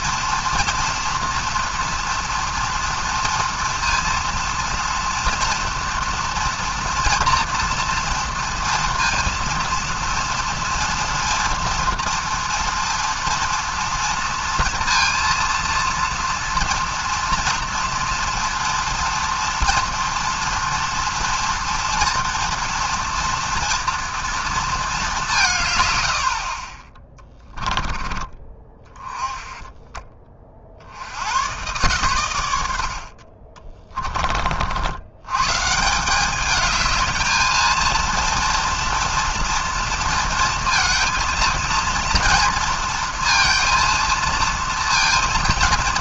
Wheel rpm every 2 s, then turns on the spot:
230, 230, 230, 230, 240, 230, 230, 230, 230, 230, 230, 230, 230, 110, 20, 10, 120, 30, 160, 230, 230, 230, 230.
none